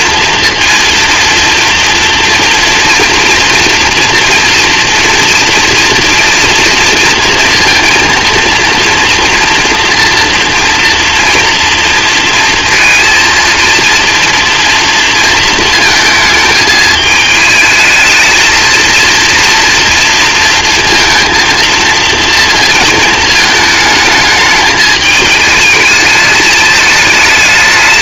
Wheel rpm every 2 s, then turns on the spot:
230, 230, 240, 230, 230, 230, 230, 230, 220, 220, 230, 230, 220, 210.
none